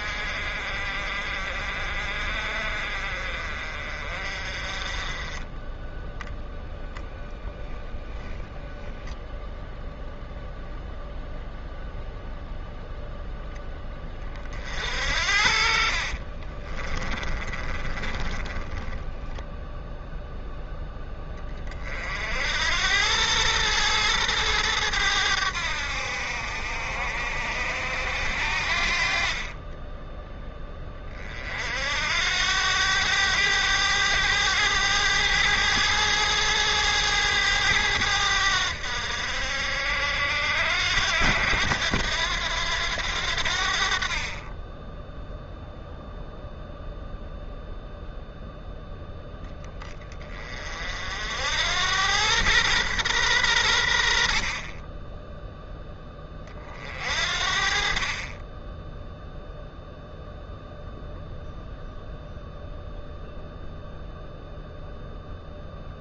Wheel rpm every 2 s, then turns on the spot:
50, 50, 40, 0, 0, 0, 0, 50, 30, 20, 0, 80, 100, 70, 60, 10, 90, 100, 110, 80, 80, 90, 20, 0, 0, 40, 120, 30, 40, 10, 0, 0, 0.
16-20